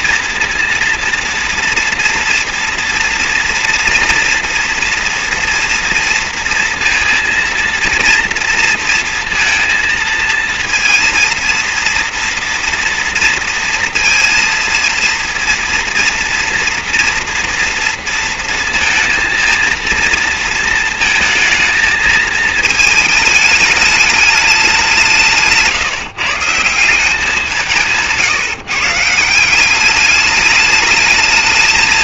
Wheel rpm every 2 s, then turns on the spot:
230, 230, 230, 230, 230, 230, 230, 230, 240, 230, 230, 220, 170, 180, 160, 220.
none